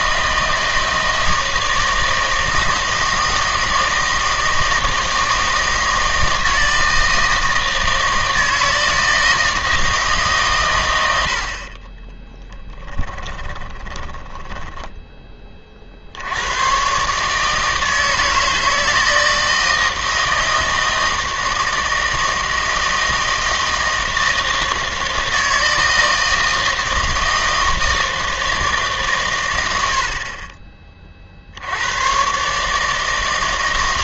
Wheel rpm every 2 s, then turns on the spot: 160, 160, 160, 160, 160, 130, 20, 10, 120, 160, 160, 160, 160, 160, 160, 30, 150.
12-16